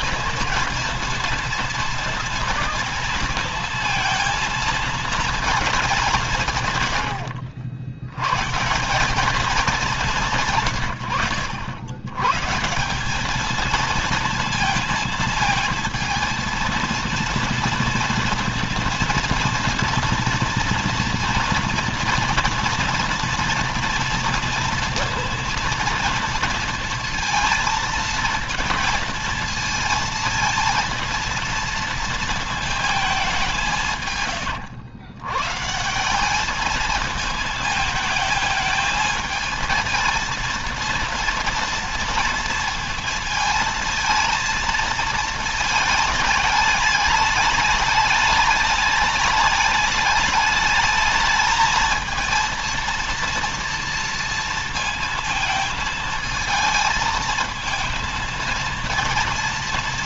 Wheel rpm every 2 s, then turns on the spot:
230, 230, 230, 100, 170, 120, 170, 230, 230, 230, 230, 230, 230, 230, 230, 230, 220, 130, 220, 220, 230, 230, 230, 210, 210, 210, 230, 230, 220, 230.
none